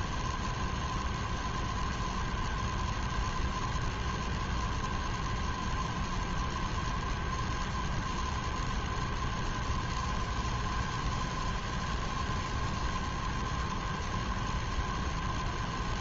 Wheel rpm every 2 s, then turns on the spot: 0, 0, 0, 0, 0, 0, 0, 0.
none